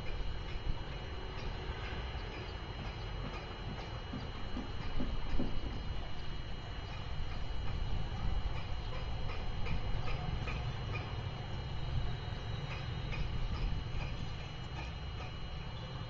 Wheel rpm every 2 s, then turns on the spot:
0, 0, 0, 0, 0, 0, 0, 0.
none